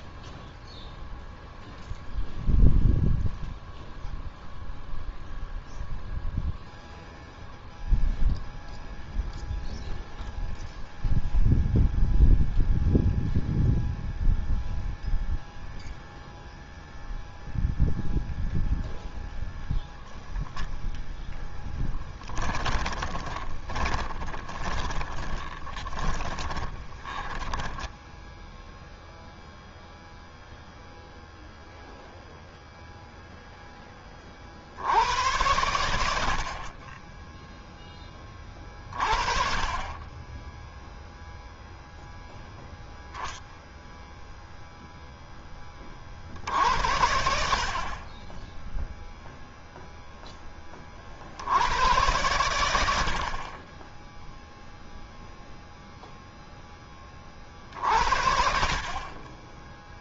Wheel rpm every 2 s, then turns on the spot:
0, 0, 0, 0, 0, 0, 0, 0, 0, 0, 0, 10, 10, 10, 0, 0, 0, 30, 60, 10, 10, 0, 0, 60, 20, 10, 100, 10, 0, 60.
22-28